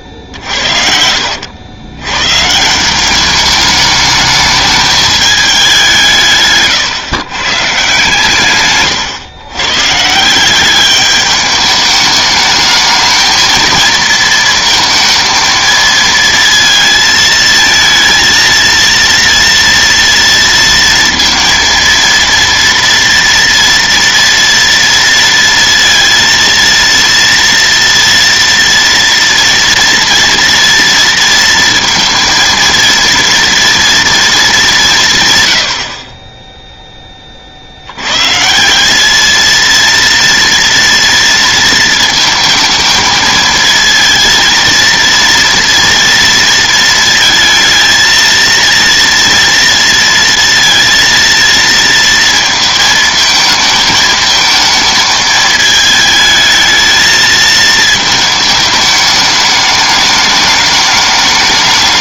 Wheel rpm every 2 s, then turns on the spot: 50, 150, 210, 140, 140, 190, 210, 230, 230, 230, 230, 230, 230, 230, 230, 230, 230, 200, 10, 160, 230, 220, 230, 230, 230, 230, 220, 220, 220, 210, 210.
6-8 36-38